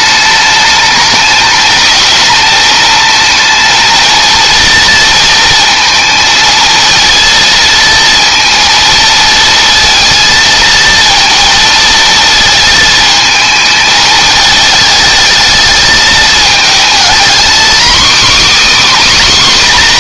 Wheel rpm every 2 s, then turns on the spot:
210, 220, 230, 230, 230, 230, 220, 220, 230, 290.
none